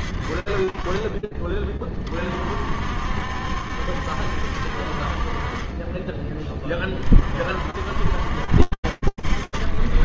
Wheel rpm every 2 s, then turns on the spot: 40, 70, 30, 50, 60.
none